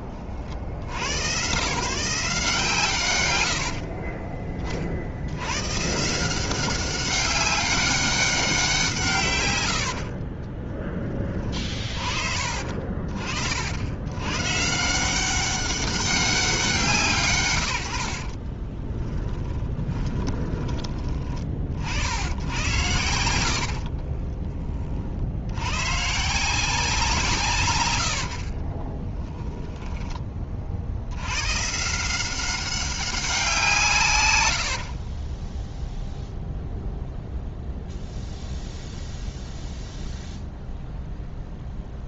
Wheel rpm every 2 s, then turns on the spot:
60, 150, 40, 190, 170, 10, 40, 150, 170, 30, 30, 90, 30, 180, 40, 50, 190, 80, 0, 0, 0.
18-20 28-30 34-36